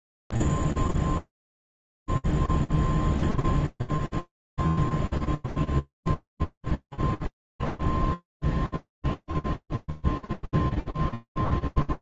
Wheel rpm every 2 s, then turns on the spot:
0, 0, 0, 0, 0, 0.
none